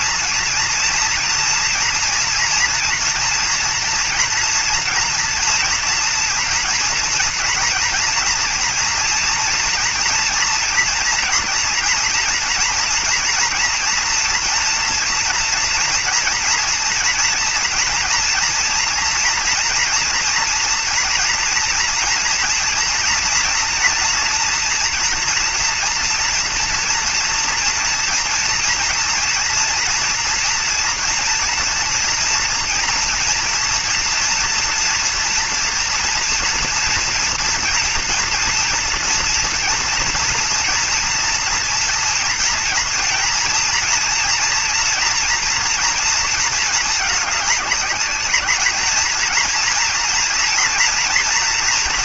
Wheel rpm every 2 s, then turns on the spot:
230, 230, 230, 230, 230, 240, 230, 230, 230, 240, 240, 230, 230, 240, 230, 230, 230, 240, 230, 230, 230, 230, 230, 220, 220, 230.
none